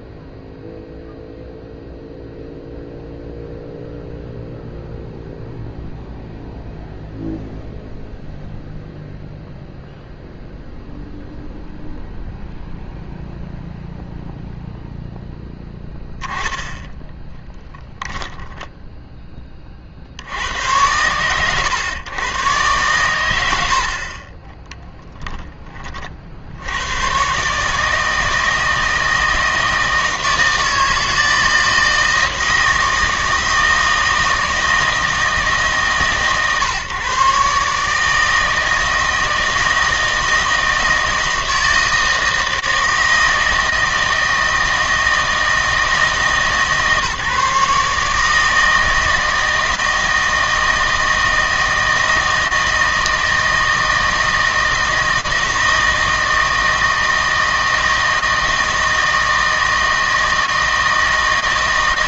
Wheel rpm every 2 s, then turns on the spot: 0, 0, 0, 0, 0, 0, 0, 0, 10, 10, 100, 120, 30, 90, 160, 160, 160, 160, 130, 160, 160, 160, 160, 150, 160, 160, 160, 160, 160, 160, 160.
18-20 24-26